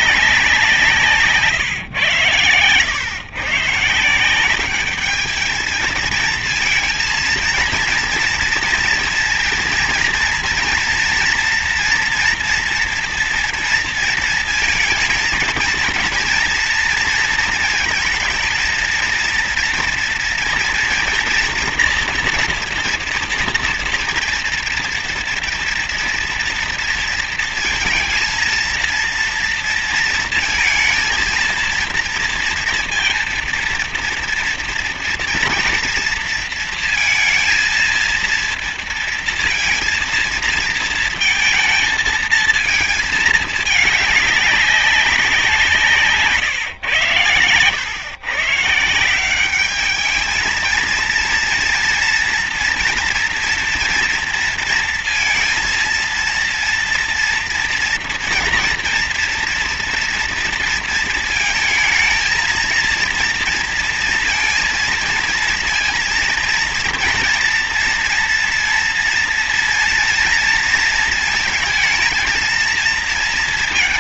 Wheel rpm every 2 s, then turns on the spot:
160, 100, 200, 230, 240, 230, 230, 220, 230, 230, 230, 230, 230, 230, 230, 230, 230, 230, 230, 230, 230, 220, 200, 130, 160, 220, 240, 230, 230, 230, 230, 220, 230, 230, 230, 230, 230.
none